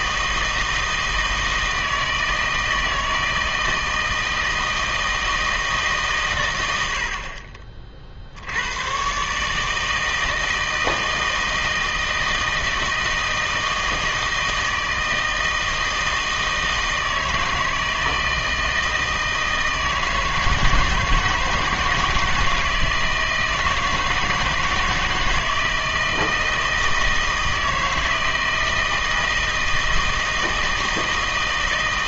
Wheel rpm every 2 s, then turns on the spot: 160, 160, 160, 100, 100, 160, 160, 160, 160, 160, 160, 160, 160, 160, 160, 160.
none